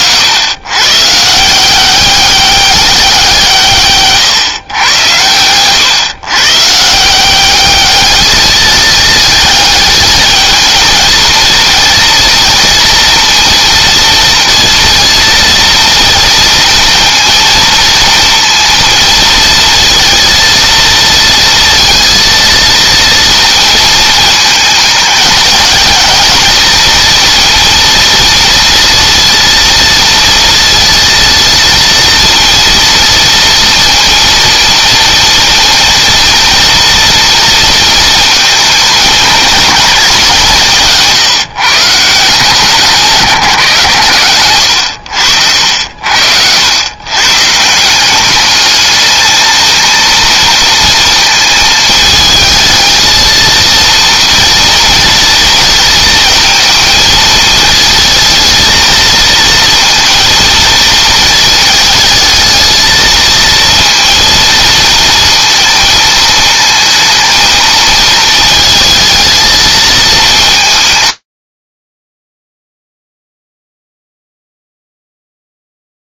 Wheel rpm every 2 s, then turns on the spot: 120, 200, 120, 150, 220, 220, 230, 230, 230, 230, 230, 230, 220, 230, 230, 230, 230, 230, 240, 220, 180, 170, 90, 100, 210, 230, 220, 230, 220, 230, 230, 220, 230, 220, 220, 150, 0, 0.
none